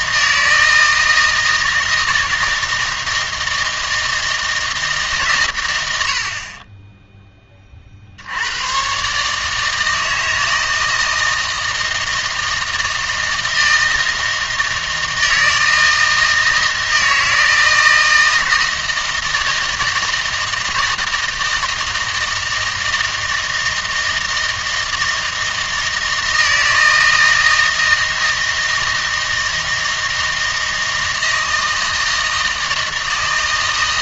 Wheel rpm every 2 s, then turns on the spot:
160, 160, 160, 30, 100, 160, 160, 160, 160, 160, 160, 160, 160, 160, 160, 160, 160.
none